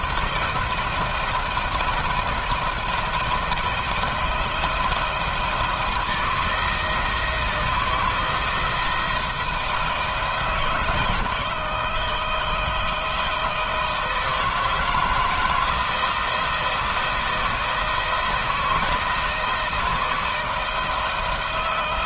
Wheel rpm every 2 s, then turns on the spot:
160, 160, 170, 160, 170, 160, 160, 160, 170, 160, 160.
none